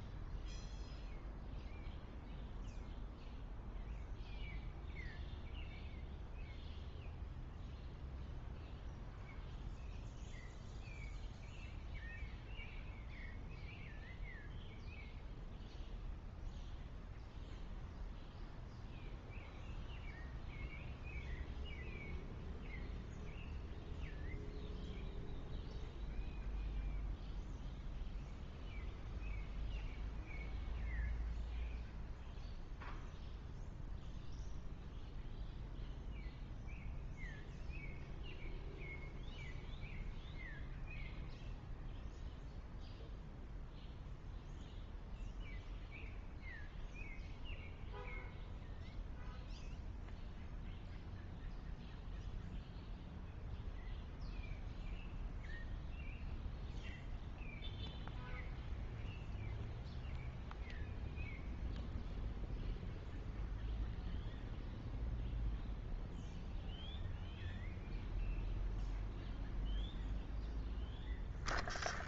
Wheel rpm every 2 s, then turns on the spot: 0, 0, 0, 0, 0, 0, 0, 0, 0, 0, 0, 0, 0, 0, 0, 0, 0, 0, 0, 0, 0, 0, 0, 0, 0, 0, 0, 0, 0, 0, 0, 0, 0, 0, 0, 0.
none